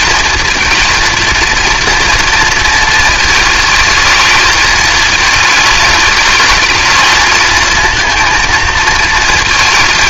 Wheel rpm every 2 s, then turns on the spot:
220, 220, 220, 220, 220.
none